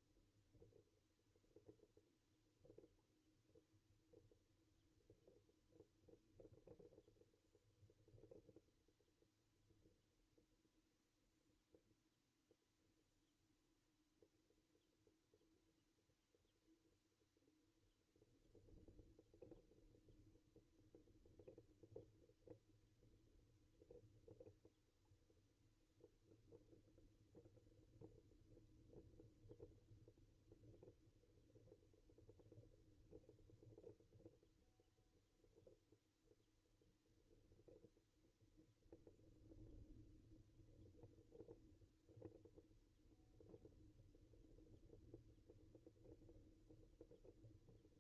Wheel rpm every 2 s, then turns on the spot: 0, 0, 0, 0, 0, 0, 0, 0, 0, 0, 0, 0, 0, 0, 0, 0, 0, 0, 0, 0, 0, 0, 0, 0.
none